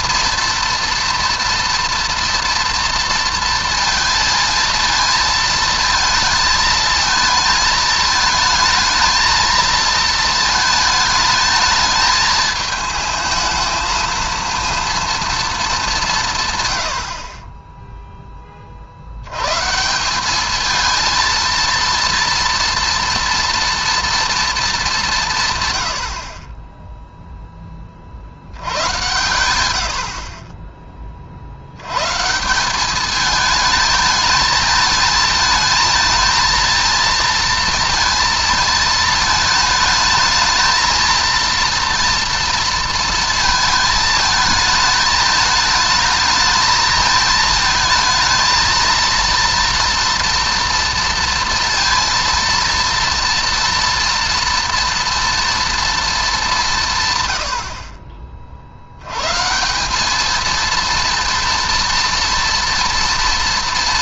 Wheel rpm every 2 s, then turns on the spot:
230, 230, 220, 220, 220, 220, 220, 230, 100, 50, 220, 230, 200, 20, 100, 40, 190, 220, 230, 220, 220, 230, 220, 220, 220, 230, 230, 230, 160, 70, 230, 230.
none